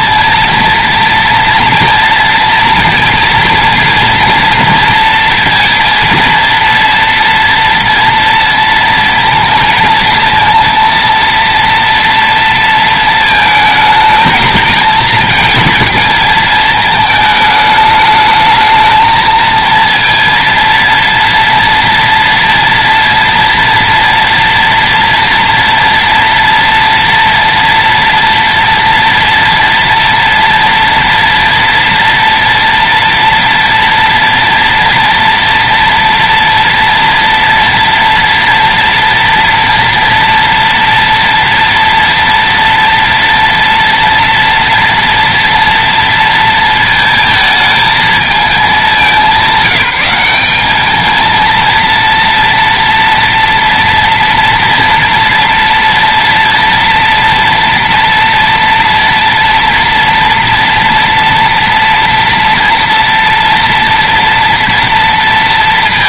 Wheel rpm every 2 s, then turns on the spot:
230, 230, 240, 230, 230, 230, 230, 220, 220, 210, 230, 230, 230, 230, 230, 230, 230, 230, 230, 230, 230, 230, 230, 230, 220, 200, 230, 230, 230, 230, 230, 230, 230.
none